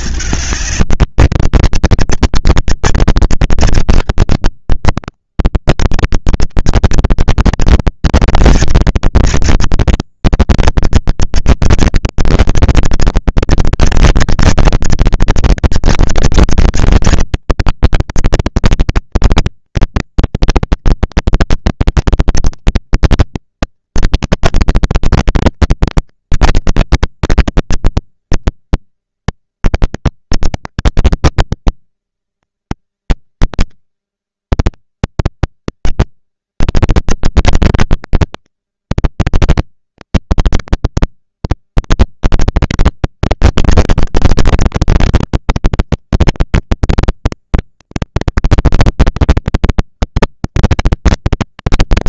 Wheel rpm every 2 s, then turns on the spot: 190, 230, 190, 190, 230, 230, 230, 220, 220, 220, 230, 220, 230, 230, 230, 240, 230, 240, 210, 220, 230, 240, 240, 240, 230, 230.
none